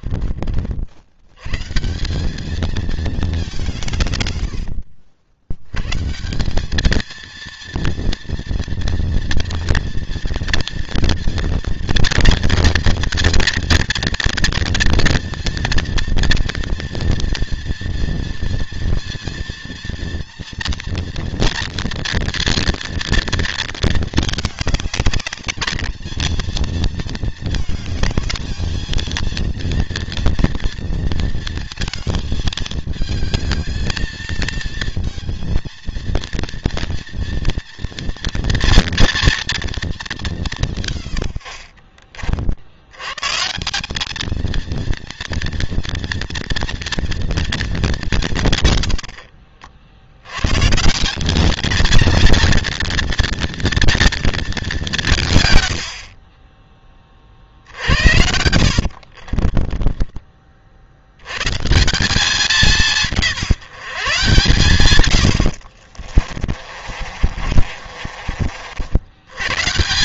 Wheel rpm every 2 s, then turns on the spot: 60, 210, 100, 190, 230, 230, 230, 230, 230, 230, 240, 230, 210, 220, 220, 230, 220, 220, 230, 230, 190, 70, 220, 230, 130, 130, 230, 210, 20, 80, 50, 190, 140, 40, 60.
58-60 66-68